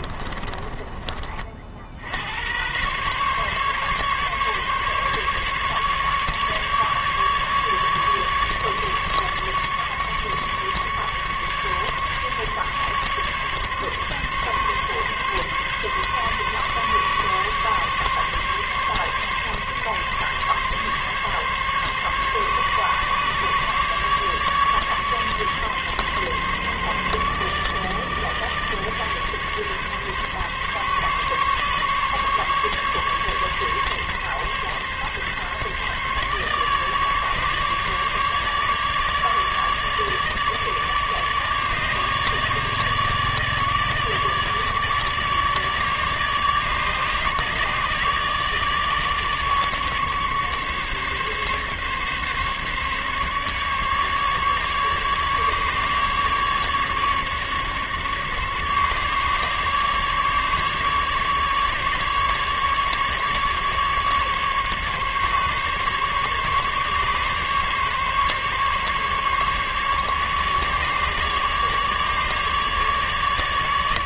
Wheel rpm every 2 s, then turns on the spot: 30, 130, 140, 150, 150, 140, 140, 140, 140, 140, 140, 140, 140, 140, 150, 140, 140, 140, 150, 150, 150, 150, 150, 150, 150, 150, 140, 150, 140, 140, 140, 140, 140, 140, 140, 150, 150.
0-2